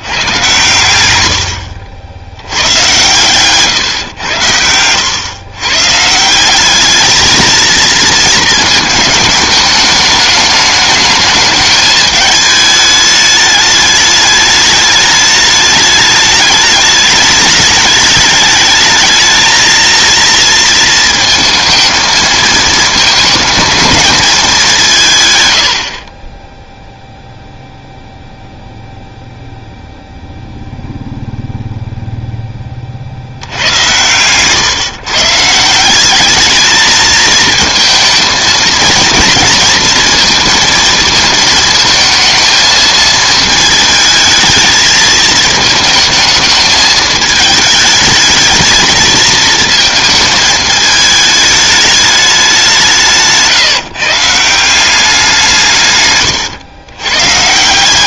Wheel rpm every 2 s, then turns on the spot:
110, 100, 90, 200, 220, 210, 210, 210, 210, 210, 230, 220, 190, 0, 0, 0, 30, 140, 220, 220, 230, 220, 220, 220, 220, 220, 180, 170, 110.
none